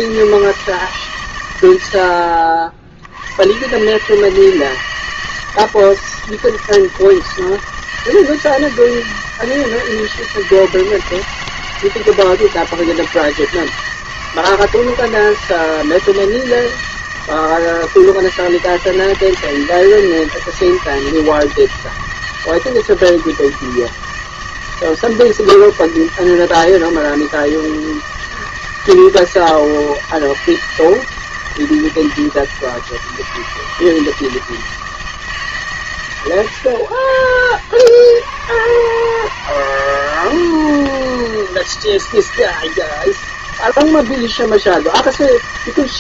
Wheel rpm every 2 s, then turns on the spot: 160, 60, 160, 160, 160, 160, 160, 160, 160, 160, 160, 160, 160, 160, 160, 160, 160, 160, 80, 130, 160, 160, 160.
none